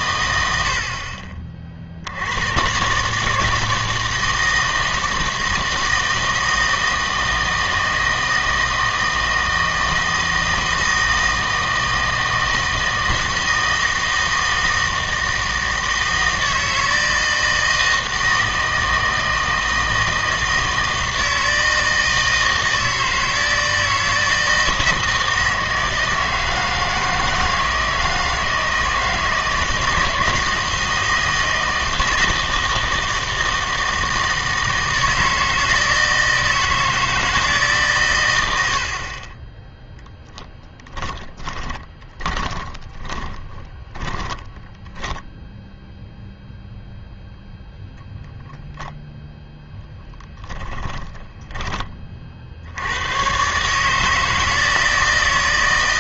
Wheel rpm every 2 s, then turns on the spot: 80, 120, 160, 160, 160, 160, 160, 160, 160, 160, 160, 160, 160, 160, 160, 160, 160, 160, 160, 80, 10, 20, 10, 0, 0, 10, 70, 160.
40-46 50-52